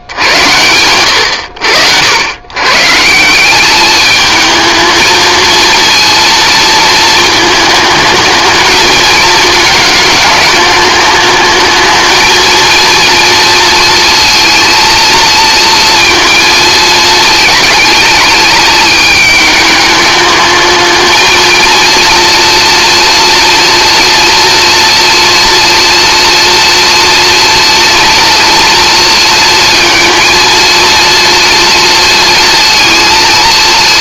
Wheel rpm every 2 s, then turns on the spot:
90, 120, 220, 230, 220, 210, 230, 230, 230, 210, 220, 230, 230, 230, 230, 230, 230.
none